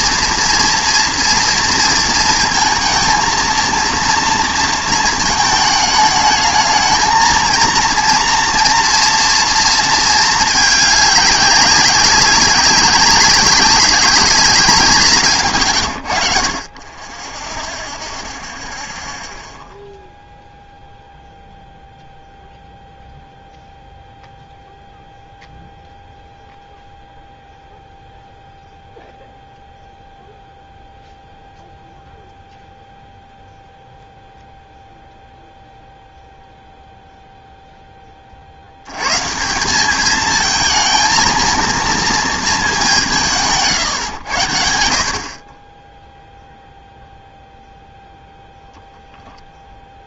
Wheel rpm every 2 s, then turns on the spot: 230, 230, 230, 220, 240, 210, 200, 180, 40, 0, 0, 0, 0, 0, 0, 0, 0, 0, 0, 90, 220, 200, 70, 0, 10.
none